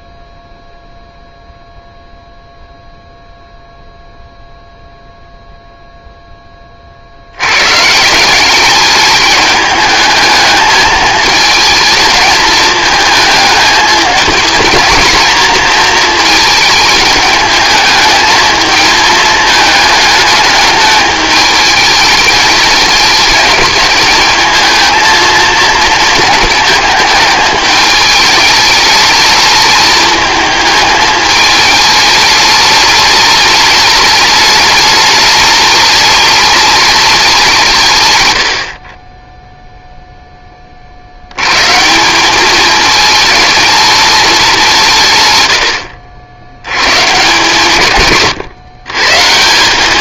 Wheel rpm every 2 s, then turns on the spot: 0, 0, 0, 30, 200, 220, 220, 220, 220, 220, 210, 220, 220, 220, 210, 220, 210, 210, 210, 50, 30, 210, 180, 130, 150.
none